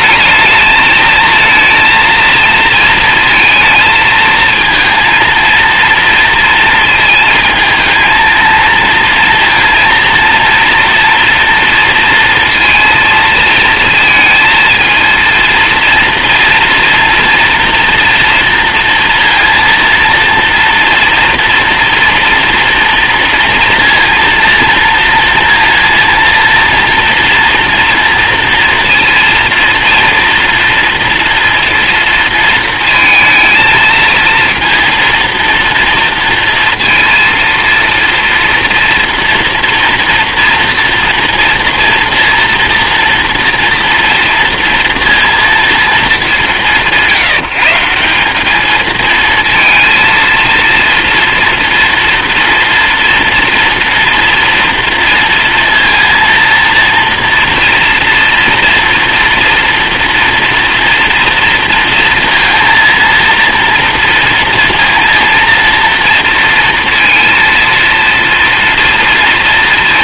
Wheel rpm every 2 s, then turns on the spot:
220, 230, 230, 230, 230, 230, 230, 230, 230, 230, 230, 230, 230, 240, 230, 230, 230, 230, 230, 230, 230, 230, 230, 170, 220, 230, 230, 230, 230, 240, 230, 230, 230, 230, 230.
none